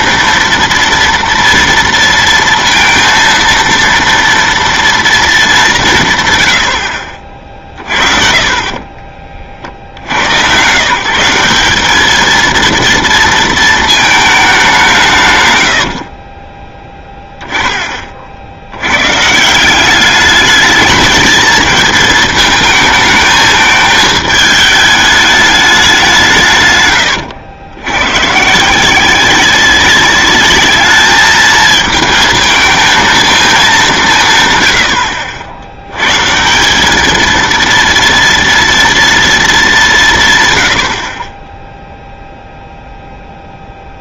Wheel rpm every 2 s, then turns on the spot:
240, 230, 230, 90, 40, 120, 230, 200, 20, 80, 210, 220, 210, 140, 160, 210, 220, 130, 190, 230, 100, 0.
8-10 16-18